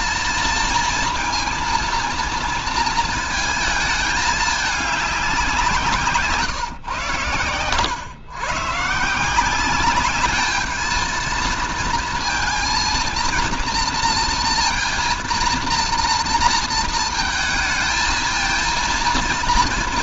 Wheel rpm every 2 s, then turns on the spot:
230, 230, 210, 130, 150, 220, 230, 230, 230, 230.
none